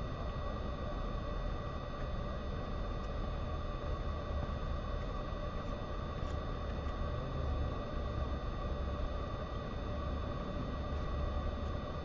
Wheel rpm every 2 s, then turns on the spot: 0, 0, 0, 0, 0, 0.
none